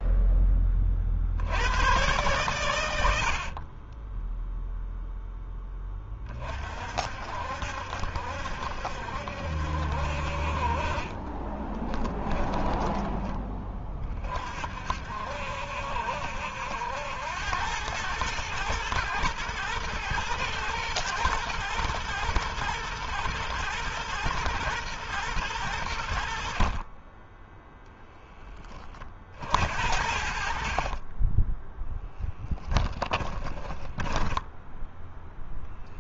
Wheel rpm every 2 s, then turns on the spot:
60, 90, 0, 50, 70, 30, 10, 60, 80, 110, 120, 110, 110, 30, 50, 20, 10, 0.
10-12 32-34